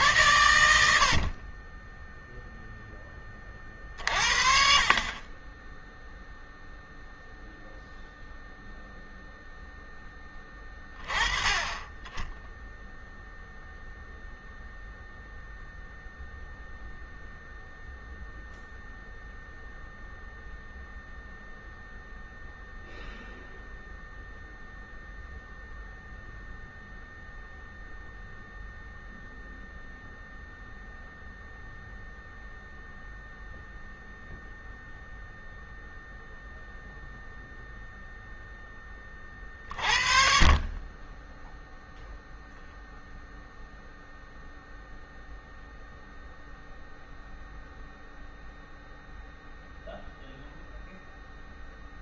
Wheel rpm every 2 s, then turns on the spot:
70, 10, 40, 0, 0, 20, 0, 0, 0, 0, 0, 0, 0, 0, 0, 0, 0, 0, 0, 20, 20, 0, 0, 0, 0, 0.
none